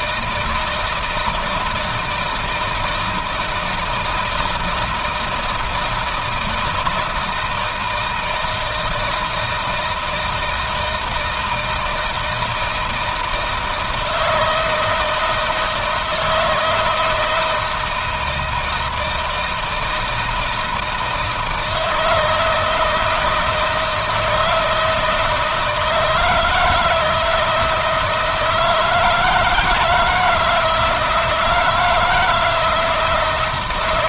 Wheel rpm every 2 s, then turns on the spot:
160, 160, 160, 160, 160, 160, 160, 160, 160, 160, 160, 160, 160, 160, 160, 170, 160.
none